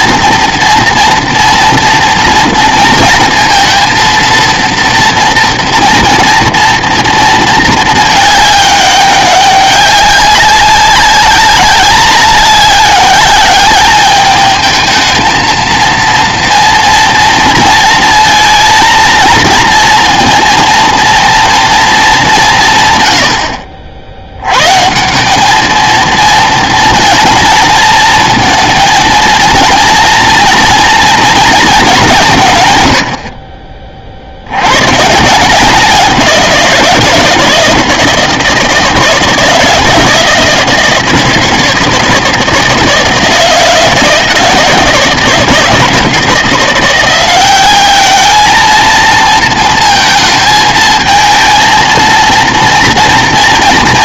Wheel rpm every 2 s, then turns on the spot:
230, 230, 230, 230, 200, 190, 200, 220, 230, 230, 230, 150, 140, 230, 230, 240, 130, 110, 180, 160, 160, 160, 160, 170, 220, 220, 230.
none